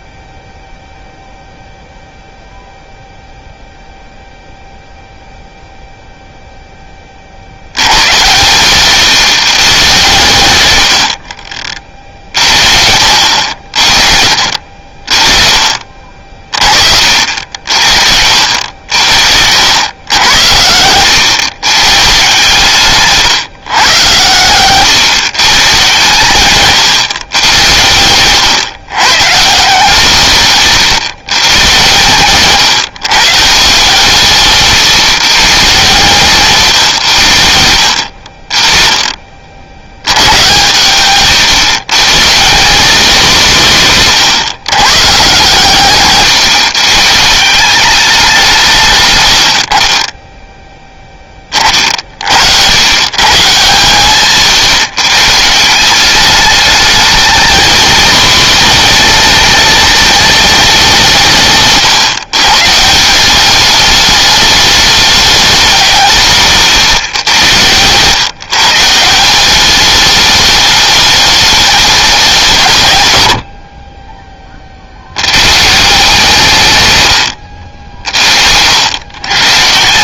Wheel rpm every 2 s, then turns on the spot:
0, 0, 0, 20, 110, 100, 60, 50, 50, 70, 100, 140, 130, 130, 130, 130, 130, 140, 120, 30, 110, 200, 130, 130, 140, 10, 120, 130, 220, 230, 180, 160, 210, 130, 150, 210, 140, 70, 130, 90.
8-10